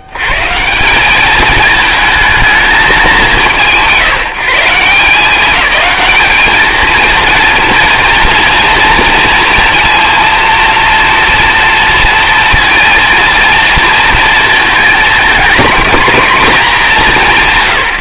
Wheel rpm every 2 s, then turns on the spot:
110, 210, 170, 220, 230, 230, 230, 230, 200.
none